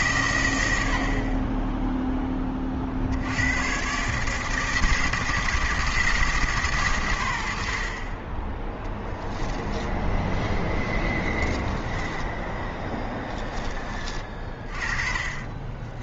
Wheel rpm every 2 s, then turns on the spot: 110, 40, 160, 140, 10, 10, 10, 40.
10-14